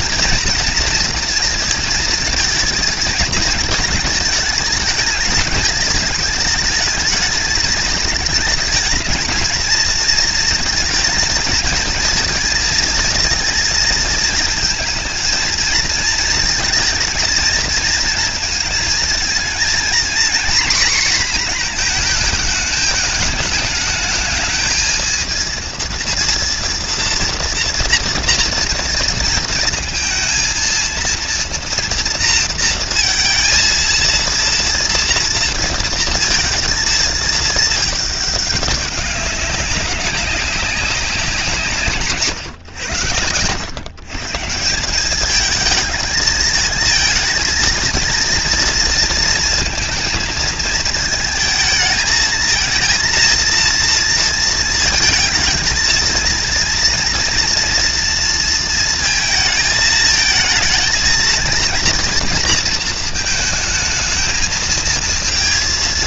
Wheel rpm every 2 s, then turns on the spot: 230, 220, 210, 210, 220, 220, 230, 220, 220, 220, 240, 210, 220, 230, 230, 230, 230, 230, 220, 200, 190, 110, 190, 230, 230, 220, 230, 220, 230, 230, 230, 220, 230.
none